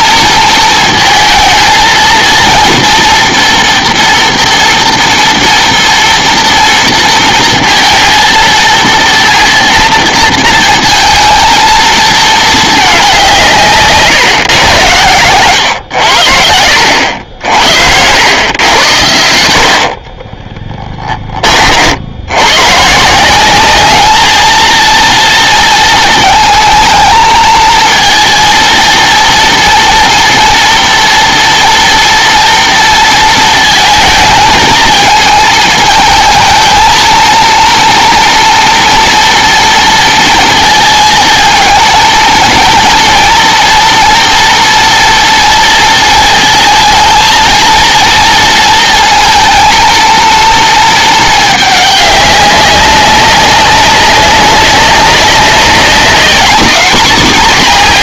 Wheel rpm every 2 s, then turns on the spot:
220, 230, 230, 230, 230, 230, 210, 130, 80, 90, 10, 130, 230, 220, 230, 230, 230, 220, 220, 240, 230, 230, 230, 220, 230, 230, 200, 190, 220.
none